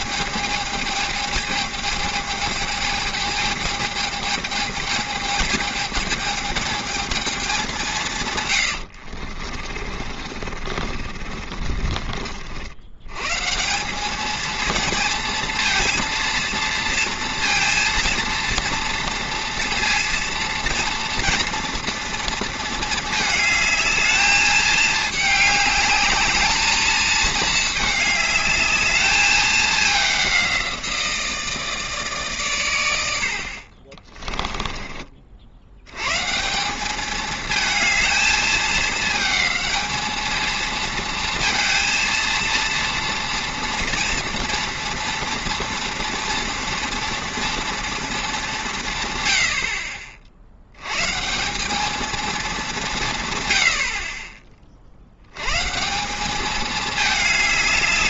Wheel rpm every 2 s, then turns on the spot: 220, 220, 220, 220, 100, 40, 80, 220, 230, 230, 230, 220, 210, 220, 210, 180, 120, 20, 180, 220, 230, 230, 230, 240, 180, 80, 200, 40, 210.
8-12 34-36